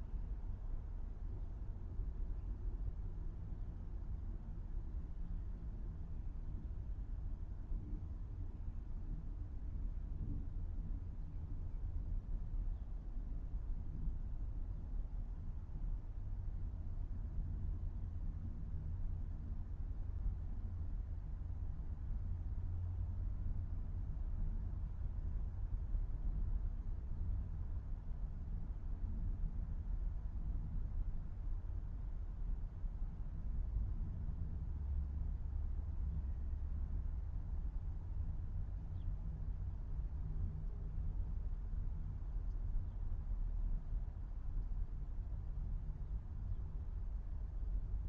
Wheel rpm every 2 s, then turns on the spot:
0, 0, 0, 0, 0, 0, 0, 0, 0, 0, 0, 0, 0, 0, 0, 0, 0, 0, 0, 0, 0, 0, 0, 0.
none